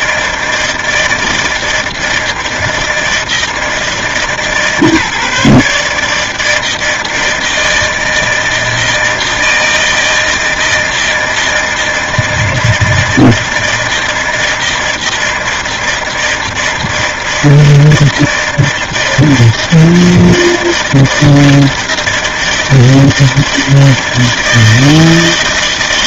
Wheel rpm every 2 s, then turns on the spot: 160, 160, 150, 160, 160, 160, 160, 160, 160, 160, 160, 160, 160.
none